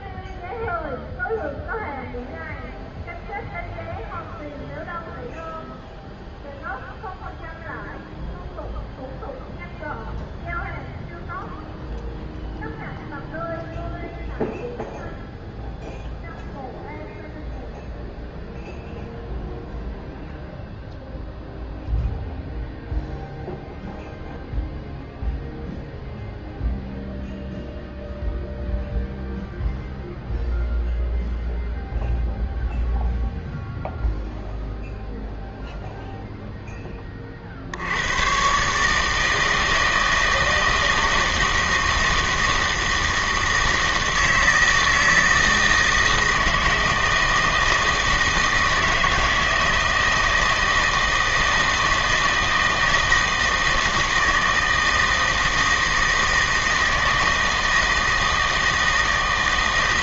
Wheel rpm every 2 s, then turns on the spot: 0, 0, 0, 0, 0, 0, 0, 0, 0, 0, 0, 0, 0, 0, 0, 0, 0, 0, 10, 140, 160, 160, 160, 160, 160, 160, 160, 160, 160, 160.
none